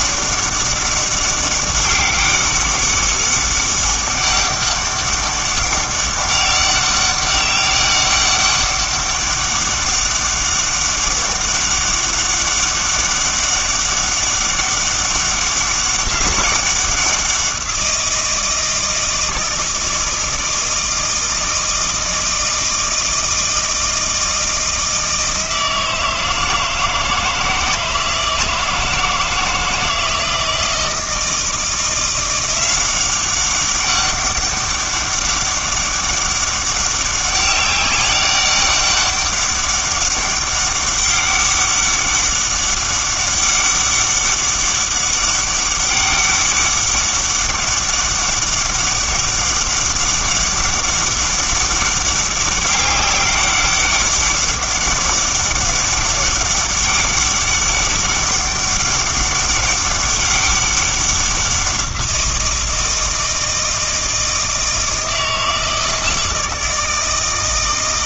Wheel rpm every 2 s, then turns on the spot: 200, 200, 200, 200, 200, 200, 200, 200, 190, 160, 160, 160, 160, 160, 160, 160, 180, 200, 200, 200, 200, 200, 200, 200, 200, 200, 200, 200, 200, 200, 200, 170, 160, 160.
none